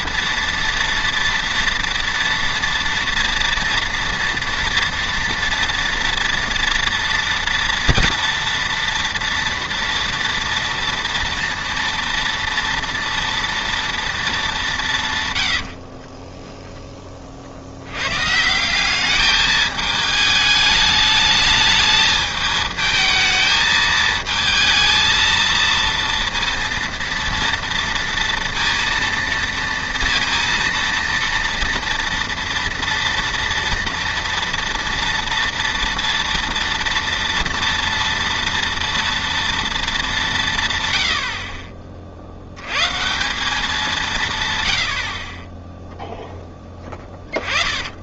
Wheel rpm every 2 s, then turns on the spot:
230, 230, 230, 230, 230, 230, 230, 190, 10, 170, 210, 220, 220, 230, 230, 230, 230, 230, 230, 230, 150, 90, 110, 10.
46-48